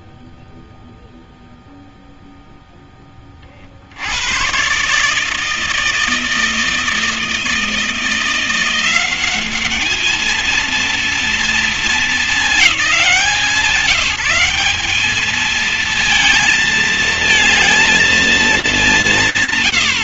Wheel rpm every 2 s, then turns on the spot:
0, 110, 160, 170, 220, 210, 190, 220, 210, 20.
none